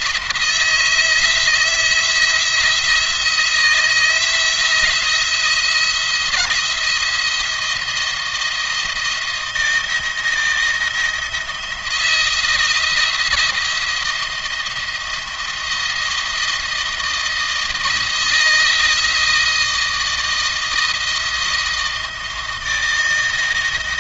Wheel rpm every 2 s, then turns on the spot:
160, 170, 170, 170, 160, 170, 170, 170, 160, 160, 160, 160.
none